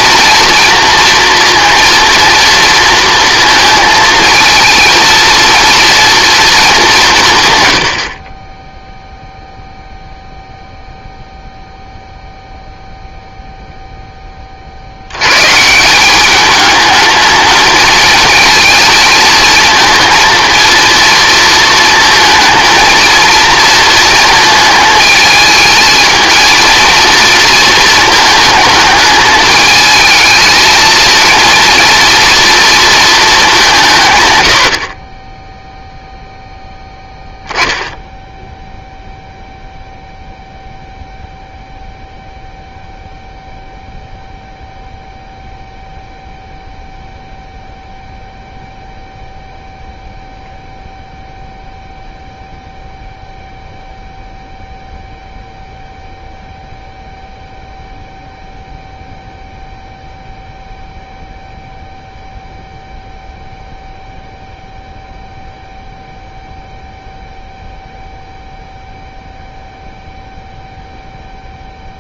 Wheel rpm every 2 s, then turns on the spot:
230, 230, 230, 210, 0, 0, 0, 60, 210, 220, 230, 230, 220, 230, 220, 220, 230, 50, 0, 0, 0, 0, 0, 0, 0, 0, 0, 0, 0, 0, 0, 0, 0, 0, 0, 0.
none